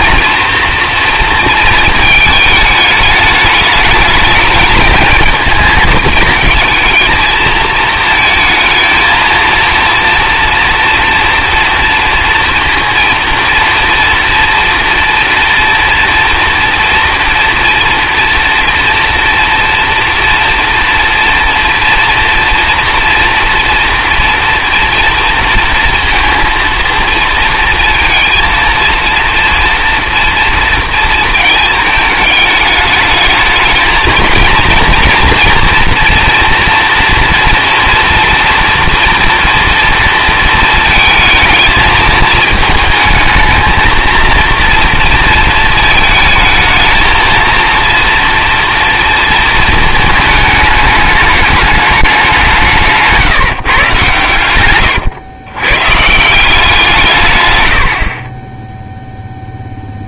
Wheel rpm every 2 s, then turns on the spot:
230, 220, 220, 220, 230, 230, 230, 240, 230, 230, 230, 240, 240, 230, 230, 230, 210, 230, 230, 230, 230, 220, 230, 220, 230, 210, 180, 110, 170, 10.
none